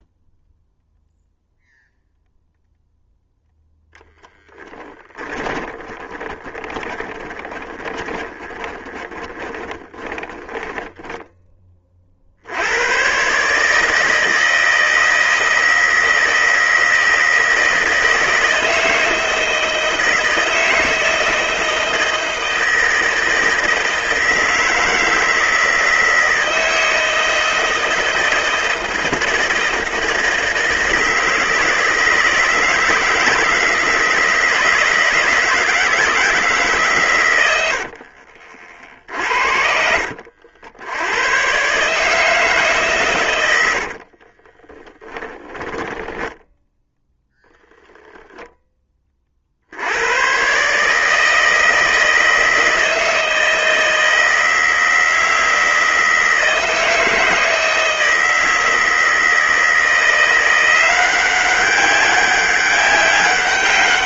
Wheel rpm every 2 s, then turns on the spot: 0, 0, 10, 20, 20, 10, 100, 160, 170, 160, 160, 160, 160, 160, 160, 160, 160, 160, 130, 50, 90, 130, 10, 0, 20, 150, 160, 160, 160, 160, 180, 200.
4-12 38-40 44-46